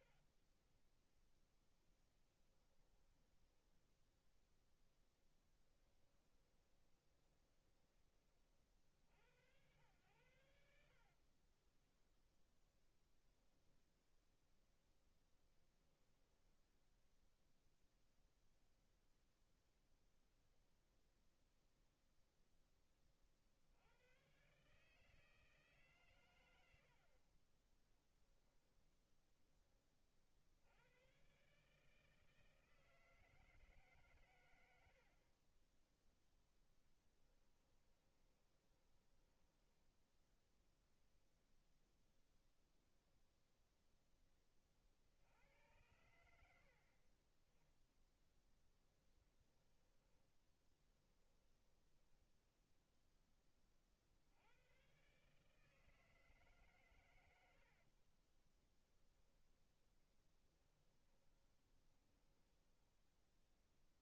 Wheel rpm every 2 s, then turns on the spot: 10, 10, 10, 20, 60, 40, 10, 0, 0, 0, 0, 30, 150, 60, 10, 110, 160, 60, 10, 20, 0, 0, 60, 40, 10, 10, 10, 130, 110, 10, 10, 10.
0-4 6-8 10-14 36-40 48-52 58-64